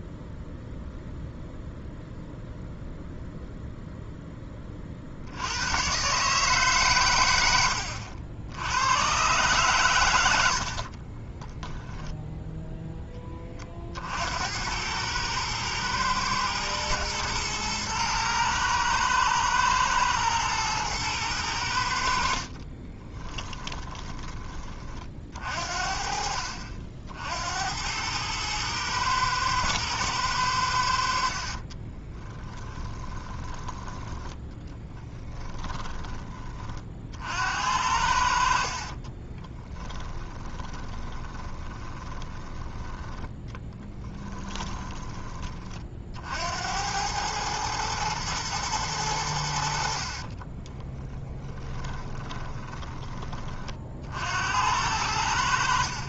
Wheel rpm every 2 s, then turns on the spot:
0, 0, 50, 120, 110, 40, 10, 100, 110, 110, 110, 30, 40, 60, 110, 70, 10, 10, 50, 30, 20, 10, 20, 90, 110, 20, 20, 80.
10-12 22-24 32-36 38-42 50-54